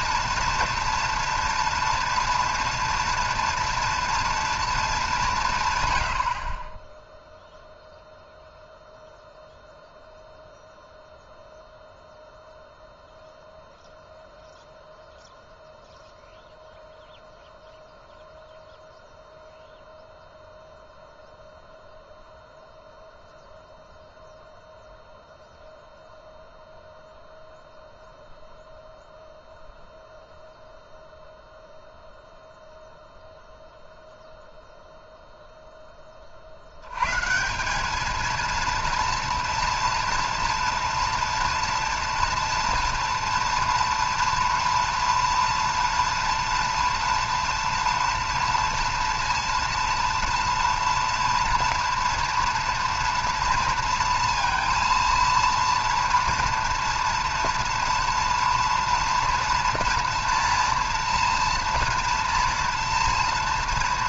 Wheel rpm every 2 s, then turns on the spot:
230, 230, 230, 30, 0, 0, 0, 0, 0, 0, 0, 0, 0, 0, 0, 0, 0, 0, 70, 230, 230, 230, 230, 230, 230, 230, 230, 230, 230, 240, 230, 230.
none